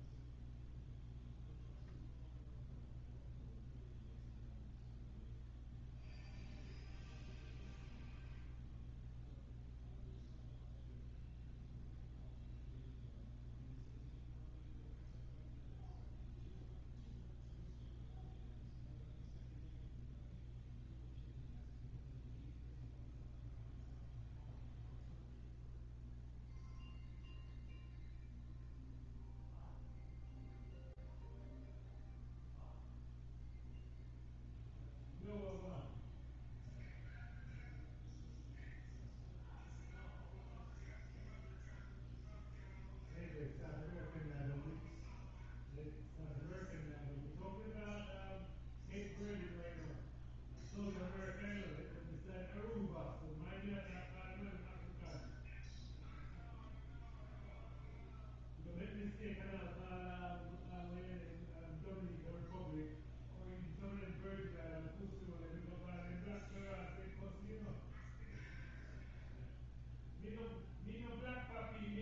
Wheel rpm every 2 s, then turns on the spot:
0, 0, 0, 0, 0, 0, 0, 0, 0, 0, 0, 0, 0, 0, 0, 0, 0, 0, 0, 0, 0, 0, 0, 0, 0, 0, 0, 0, 0, 0, 0, 0, 0, 0, 0, 0.
none